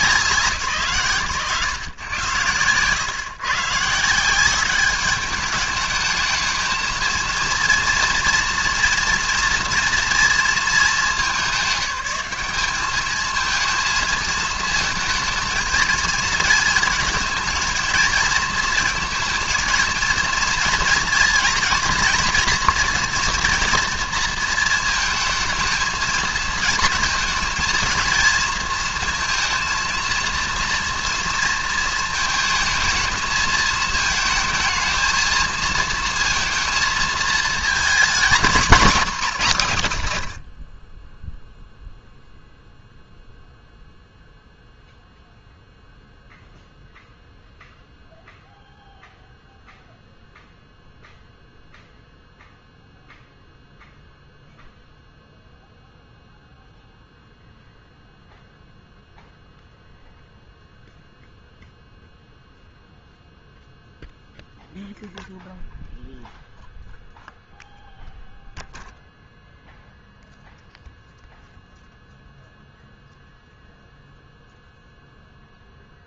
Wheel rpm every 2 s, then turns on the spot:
160, 110, 200, 220, 230, 210, 200, 220, 220, 230, 240, 230, 220, 220, 230, 230, 220, 230, 220, 220, 20, 0, 0, 0, 0, 0, 0, 0, 0, 0, 0, 0, 0, 0, 0, 0, 0, 0.
38-40